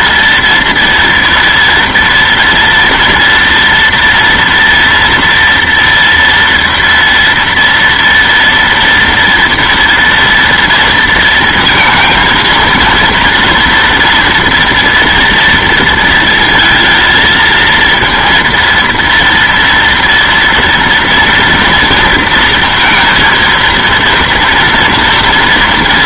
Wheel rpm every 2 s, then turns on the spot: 230, 230, 240, 230, 230, 230, 230, 240, 230, 230, 230, 230, 230.
none